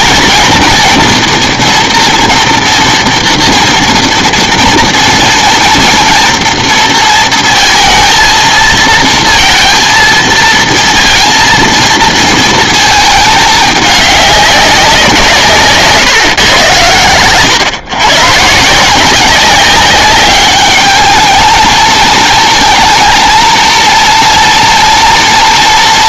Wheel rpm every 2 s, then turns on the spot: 230, 240, 240, 230, 230, 230, 220, 190, 120, 170, 210, 230, 240.
none